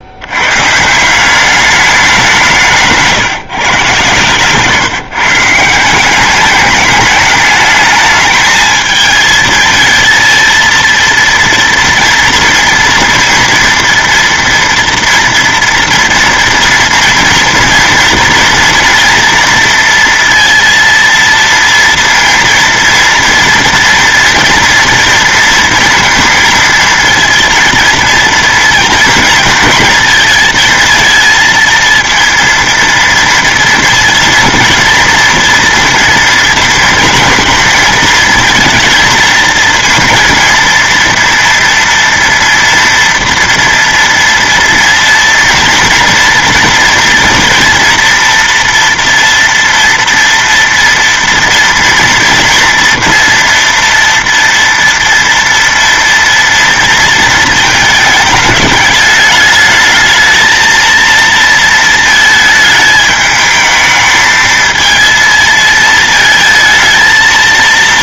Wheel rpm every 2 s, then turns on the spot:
140, 170, 140, 210, 220, 230, 230, 230, 230, 230, 230, 230, 230, 230, 230, 230, 230, 230, 230, 220, 230, 230, 230, 230, 230, 230, 230, 230, 230, 210, 220, 220, 220, 220.
2-4